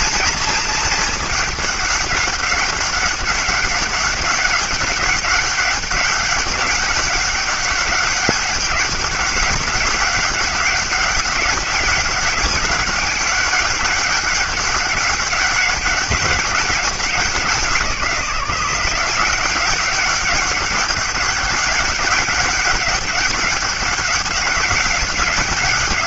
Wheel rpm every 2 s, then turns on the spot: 220, 200, 190, 200, 200, 200, 200, 200, 190, 170, 200, 190, 190.
none